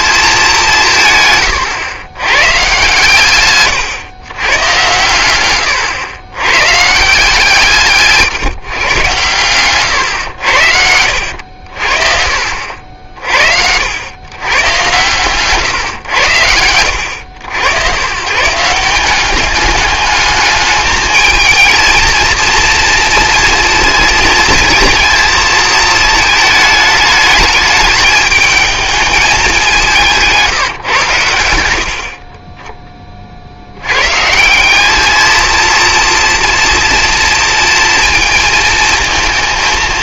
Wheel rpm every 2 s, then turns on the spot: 180, 130, 120, 120, 130, 80, 60, 120, 100, 160, 210, 230, 220, 220, 210, 160, 30, 180, 230, 230.
10-12